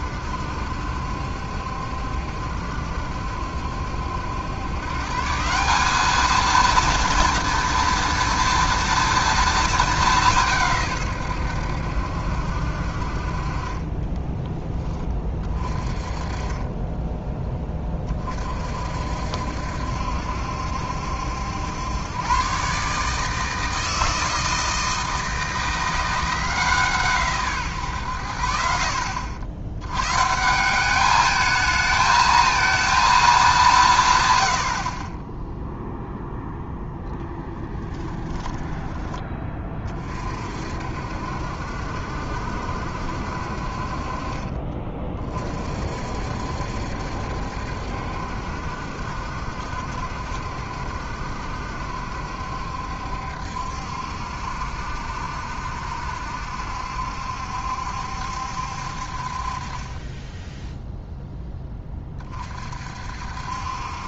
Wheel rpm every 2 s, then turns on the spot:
70, 70, 130, 230, 230, 150, 60, 20, 20, 50, 70, 140, 160, 160, 60, 190, 230, 30, 0, 10, 50, 70, 30, 70, 70, 70, 70, 70, 70, 60, 0, 50.
38-40